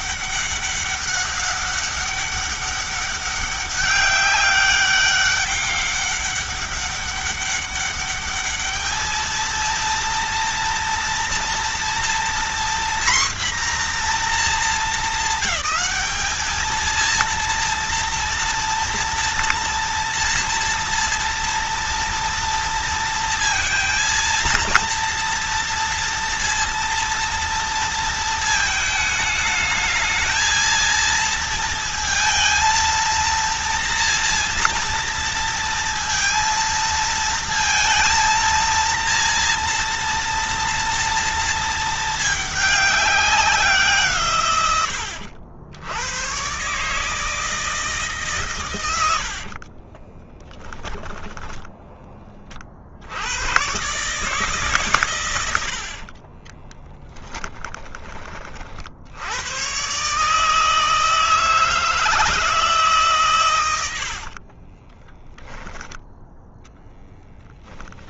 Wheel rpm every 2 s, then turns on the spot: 200, 200, 200, 200, 210, 230, 240, 230, 230, 230, 230, 230, 230, 230, 220, 230, 230, 230, 230, 230, 230, 200, 100, 150, 100, 10, 60, 150, 20, 60, 160, 150, 20, 0.
50-52 56-58 64-66